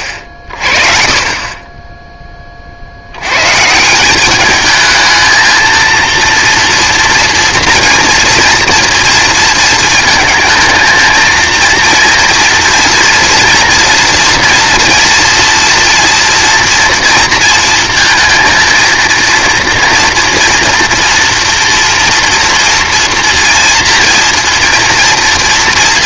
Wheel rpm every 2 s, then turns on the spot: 30, 60, 210, 230, 230, 230, 230, 230, 230, 230, 230, 240, 230.
none